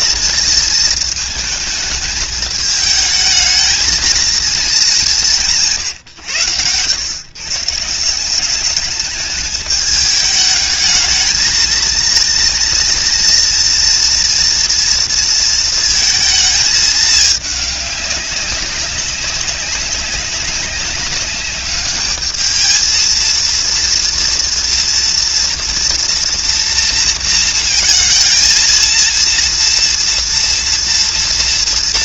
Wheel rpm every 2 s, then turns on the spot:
230, 210, 210, 110, 200, 210, 230, 230, 220, 190, 200, 220, 230, 230, 230, 240.
none